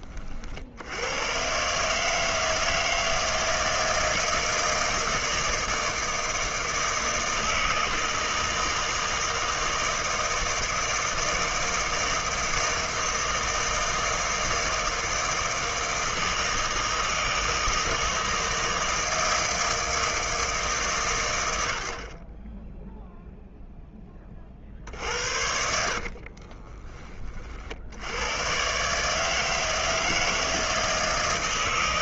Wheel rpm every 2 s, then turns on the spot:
110, 160, 160, 160, 160, 160, 160, 160, 160, 160, 100, 0, 60, 30, 140, 160.
24-26